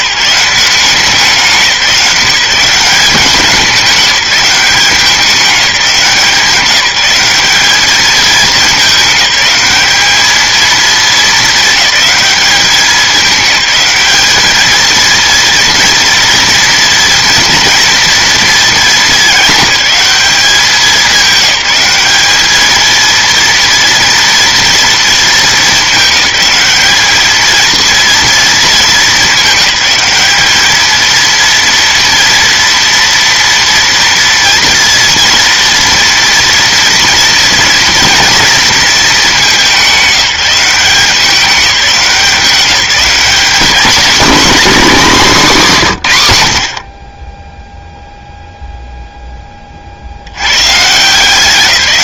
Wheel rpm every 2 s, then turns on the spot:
180, 170, 180, 180, 210, 220, 200, 220, 230, 220, 200, 220, 230, 210, 210, 220, 230, 230, 230, 230, 180, 200, 260, 80, 0, 130.
none